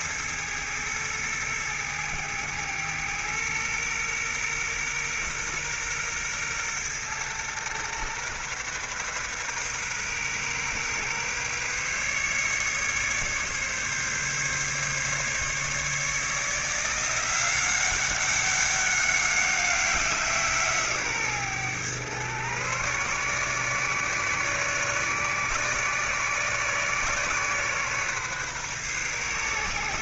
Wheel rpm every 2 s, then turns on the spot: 110, 110, 120, 120, 130, 130, 140, 140, 170, 200, 150, 130, 140, 140, 130.
none